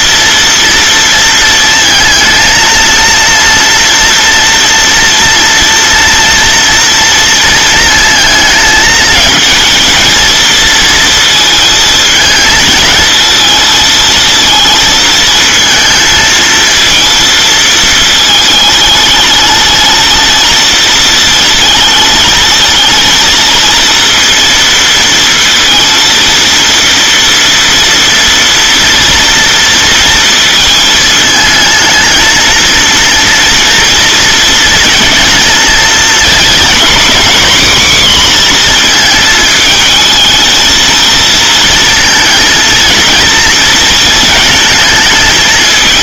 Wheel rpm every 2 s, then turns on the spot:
230, 230, 230, 230, 220, 230, 220, 220, 220, 210, 230, 220, 230, 230, 230, 230, 230, 230, 230, 240, 230, 230, 230.
none